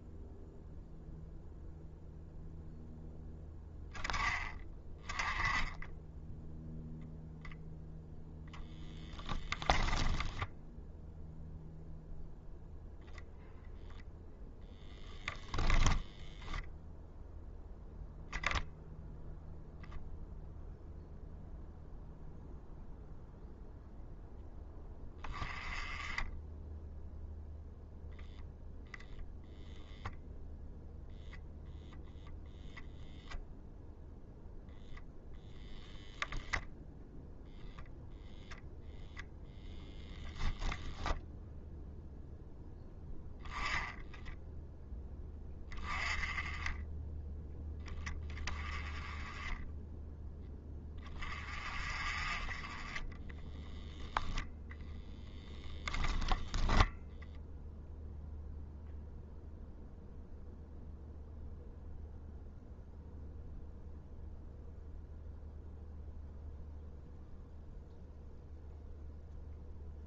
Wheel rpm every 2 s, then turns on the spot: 0, 0, 20, 0, 0, 0, 0, 0, 0, 0, 0, 0, 10, 10, 0, 0, 0, 0, 10, 0, 10, 0, 0, 10, 10, 10, 10, 0, 0, 0, 0, 0, 0, 0, 0.
none